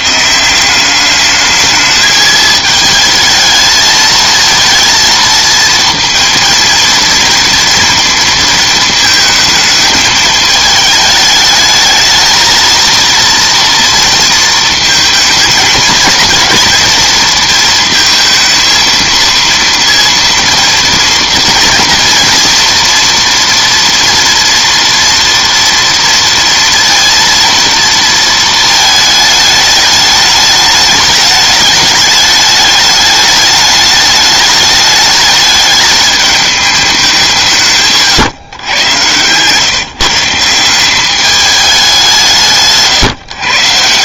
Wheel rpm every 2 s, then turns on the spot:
170, 220, 220, 230, 220, 220, 220, 230, 230, 230, 230, 230, 230, 230, 220, 210, 210, 210, 210, 120, 170, 150.
none